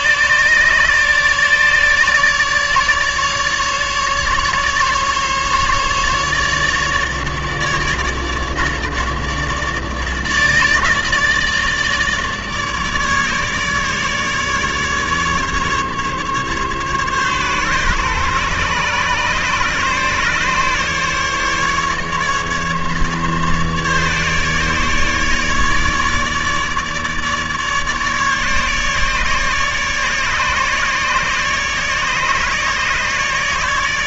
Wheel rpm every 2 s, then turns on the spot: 150, 150, 140, 150, 150, 150, 150, 150, 140, 140, 150, 150, 150, 150, 150, 150, 150.
none